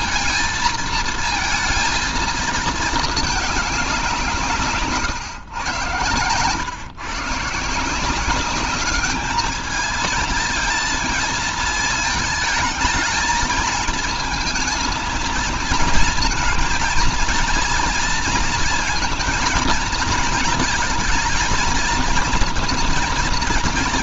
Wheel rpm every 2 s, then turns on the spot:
230, 220, 140, 110, 190, 220, 220, 220, 230, 230, 220, 230.
none